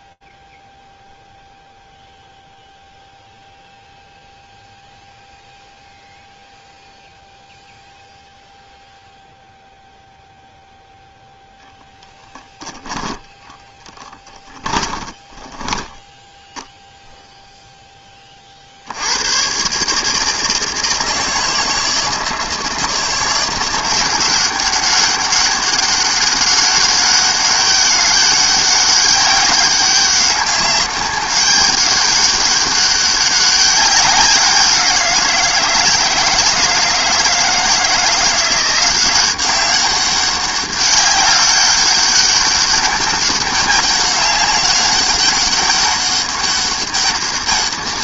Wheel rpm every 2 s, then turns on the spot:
0, 0, 0, 0, 0, 0, 0, 10, 0, 70, 160, 170, 190, 200, 200, 200, 200, 180, 160, 180, 200, 200, 200, 200.
14-16